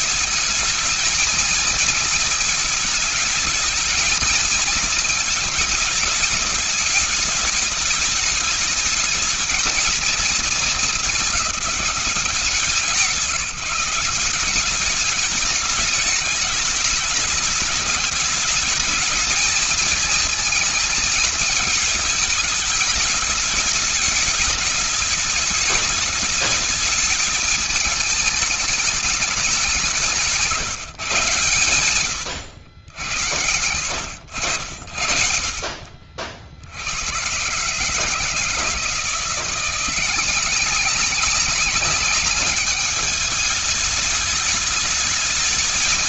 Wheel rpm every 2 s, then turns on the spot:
230, 220, 220, 210, 220, 220, 180, 210, 210, 220, 220, 210, 210, 210, 210, 130, 80, 40, 110, 170, 190, 210, 210.
none